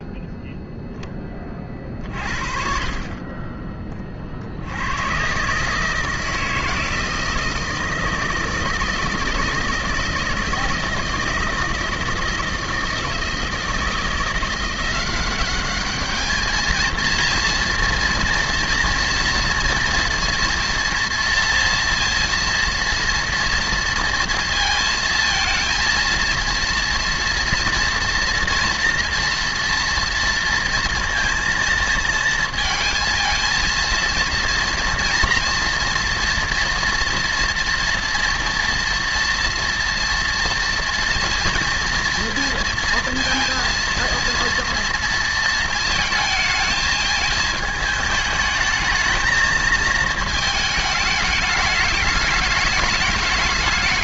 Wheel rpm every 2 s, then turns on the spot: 0, 40, 90, 160, 160, 160, 160, 180, 230, 230, 230, 230, 230, 230, 230, 230, 230, 230, 230, 240, 230, 230, 230, 220, 220, 210, 210.
none